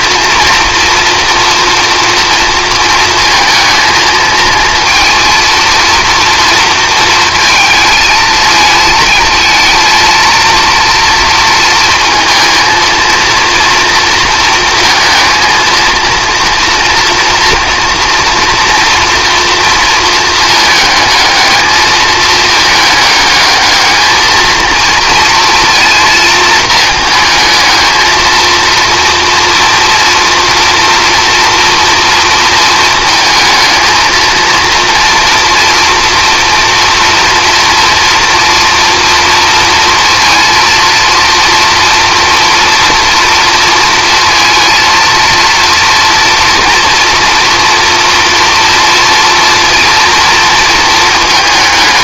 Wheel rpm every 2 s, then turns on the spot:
230, 230, 230, 230, 220, 230, 230, 230, 230, 230, 220, 220, 230, 230, 220, 230, 220, 230, 240, 230, 230, 230, 230, 230, 230, 230.
none